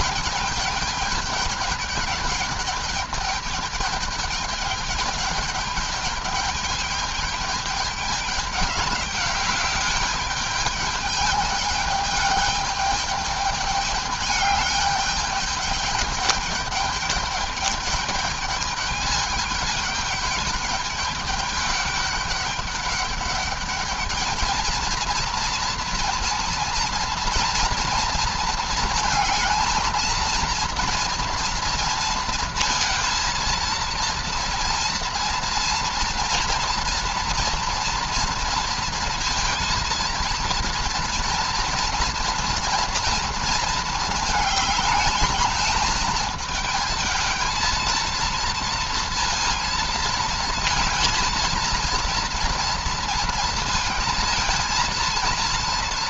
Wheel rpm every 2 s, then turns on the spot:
210, 210, 210, 210, 200, 210, 210, 210, 210, 210, 210, 200, 220, 230, 230, 230, 230, 230, 230, 230, 230, 230, 220, 220, 230, 230, 230, 230.
none